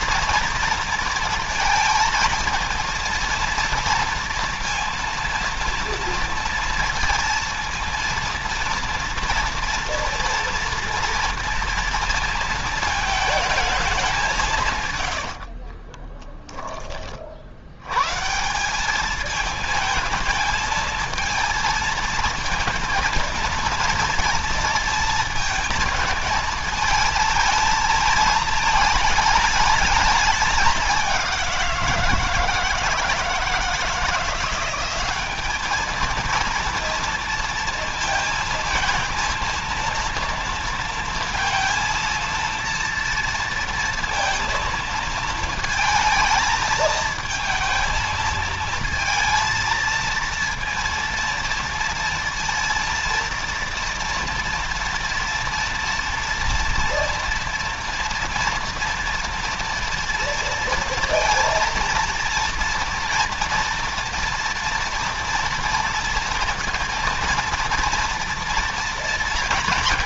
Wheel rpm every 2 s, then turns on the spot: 230, 220, 230, 230, 230, 230, 230, 160, 30, 170, 220, 220, 230, 220, 220, 210, 160, 180, 230, 230, 230, 230, 230, 220, 220, 230, 230, 230, 230, 230, 230, 230, 230, 230, 230.
16-18